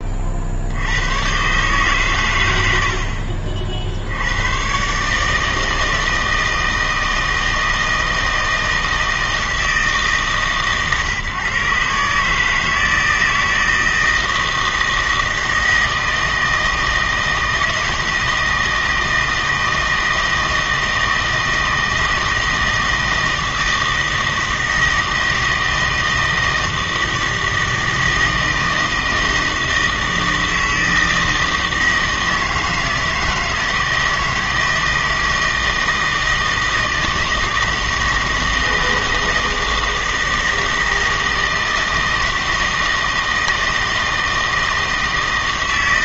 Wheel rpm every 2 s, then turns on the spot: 60, 90, 120, 160, 160, 140, 160, 160, 160, 160, 160, 160, 160, 160, 160, 160, 160, 160, 160, 160, 160, 160, 160.
none